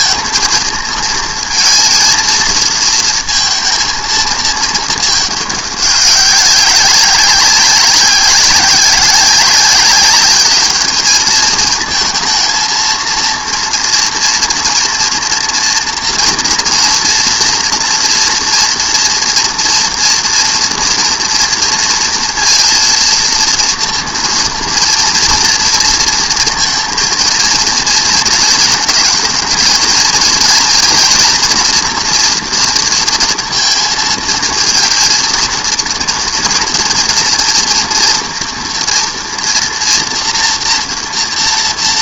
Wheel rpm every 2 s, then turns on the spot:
220, 230, 220, 190, 190, 210, 230, 230, 230, 230, 230, 230, 230, 230, 220, 230, 230, 230, 230, 230, 240.
none